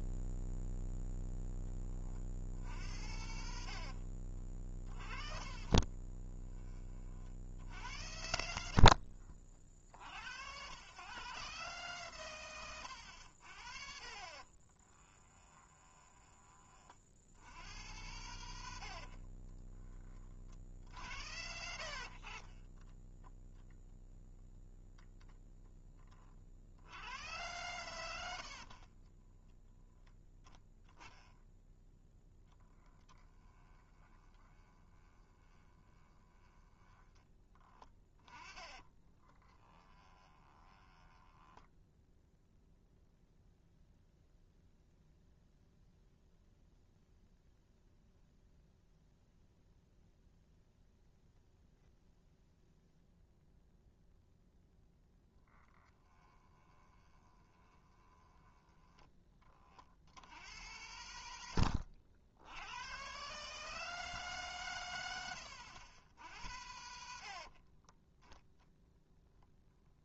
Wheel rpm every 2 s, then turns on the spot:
0, 70, 30, 30, 60, 120, 90, 20, 50, 80, 70, 10, 0, 80, 40, 10, 10, 20, 10, 30, 20, 0, 0, 0, 0, 0, 0, 0, 20, 10, 110, 110, 110, 70, 0.
4-6 8-10 12-16 20-24 28-30 32-36 38-42 56-58